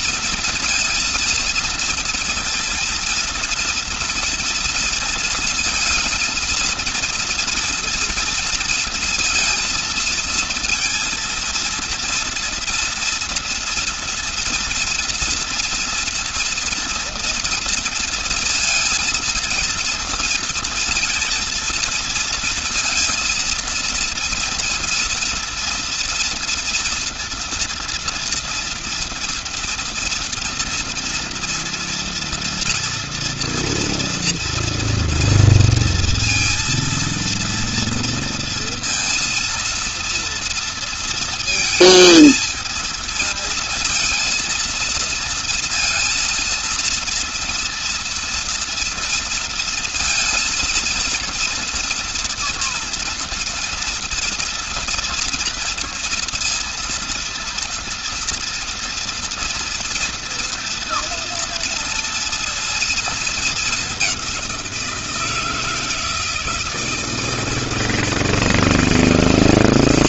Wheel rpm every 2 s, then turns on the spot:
230, 230, 230, 230, 230, 230, 230, 230, 240, 230, 230, 230, 230, 240, 230, 240, 230, 230, 230, 230, 230, 230, 230, 230, 230, 230, 230, 230, 230, 230, 230, 220, 170, 160, 160.
none